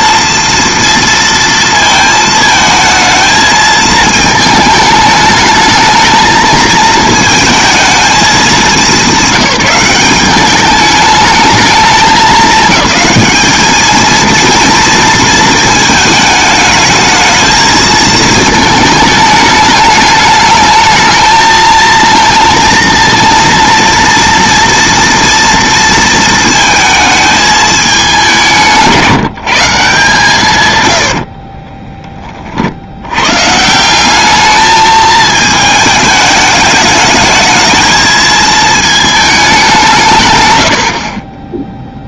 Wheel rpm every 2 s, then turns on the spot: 230, 220, 220, 220, 200, 210, 210, 230, 220, 220, 220, 230, 230, 220, 180, 120, 70, 210, 210, 220, 100.
none